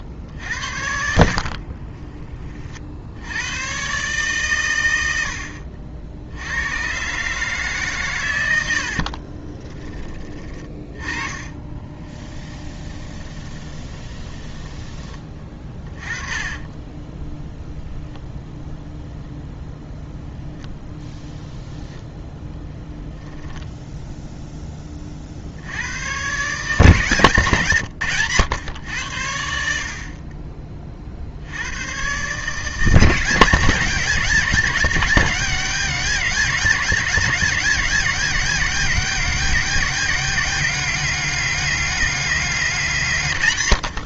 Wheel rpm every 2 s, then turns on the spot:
40, 100, 70, 150, 30, 20, 20, 20, 10, 0, 0, 0, 50, 150, 80, 70, 180, 200, 200, 200, 200, 140.
0-2 8-14 16-18